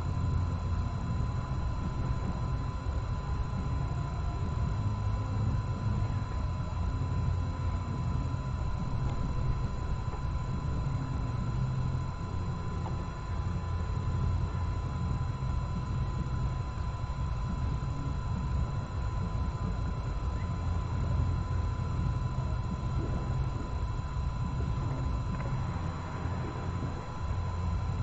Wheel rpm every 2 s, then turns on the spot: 0, 0, 0, 0, 0, 0, 0, 0, 0, 0, 0, 0, 0, 0.
none